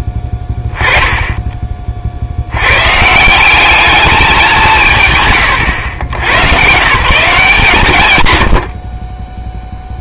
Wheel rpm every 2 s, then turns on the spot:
10, 120, 180, 140, 60.
none